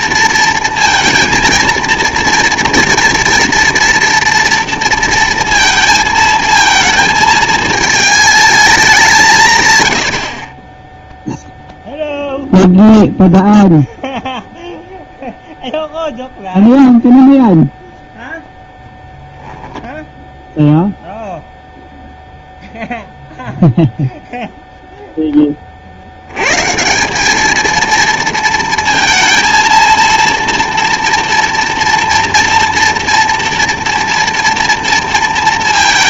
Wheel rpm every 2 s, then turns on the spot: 230, 240, 230, 230, 200, 10, 0, 0, 0, 0, 0, 0, 0, 150, 230, 230, 230, 230.
none